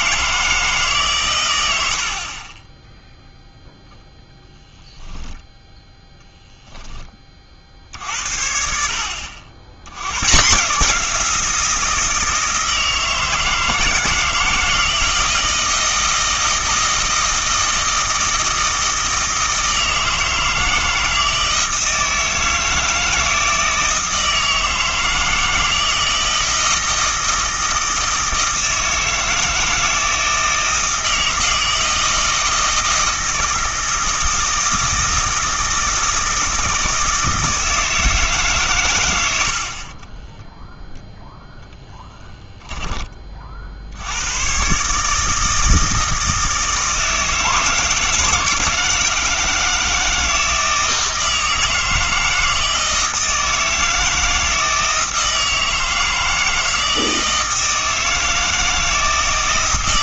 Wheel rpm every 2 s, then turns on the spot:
150, 20, 10, 10, 60, 160, 160, 160, 160, 160, 160, 160, 160, 160, 160, 160, 160, 160, 160, 130, 0, 10, 130, 160, 160, 160, 160, 160, 160, 160.
4-6